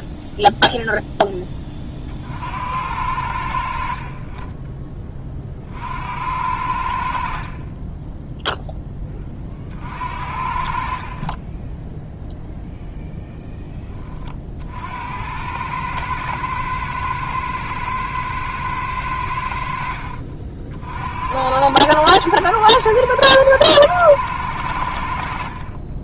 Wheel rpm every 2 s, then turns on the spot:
0, 50, 20, 80, 0, 50, 0, 50, 110, 110, 60, 110, 90.
none